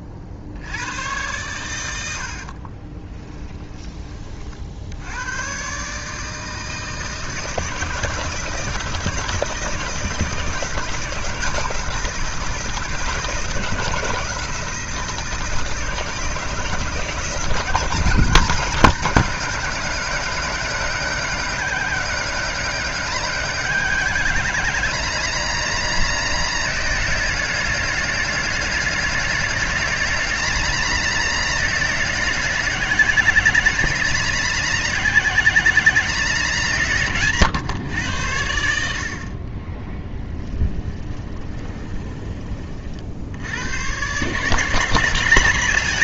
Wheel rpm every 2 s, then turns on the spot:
100, 30, 70, 160, 160, 160, 160, 160, 160, 190, 180, 180, 180, 180, 180, 180, 180, 180, 160, 60, 20, 40, 150.
2-4 40-42